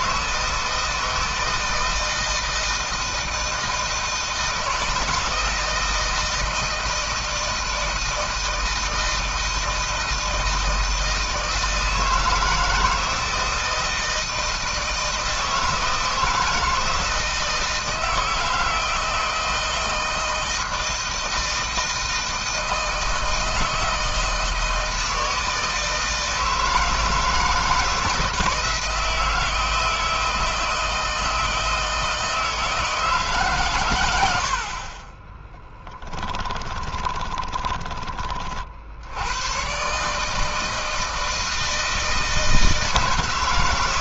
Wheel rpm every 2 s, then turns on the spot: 160, 160, 160, 160, 160, 160, 160, 160, 160, 160, 160, 160, 160, 160, 160, 160, 160, 50, 20, 40, 150, 160.
36-38